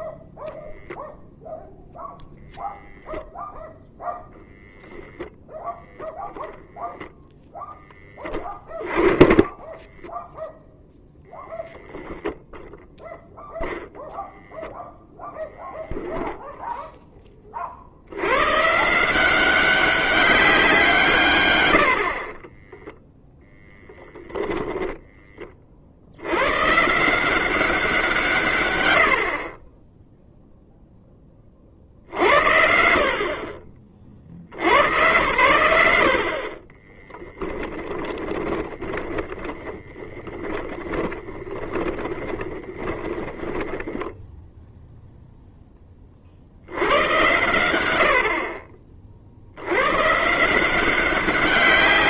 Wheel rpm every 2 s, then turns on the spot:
0, 0, 0, 10, 20, 10, 0, 0, 20, 170, 150, 10, 20, 180, 100, 10, 60, 90, 10, 30, 20, 10, 0, 90, 30, 180.
22-24 28-30 36-44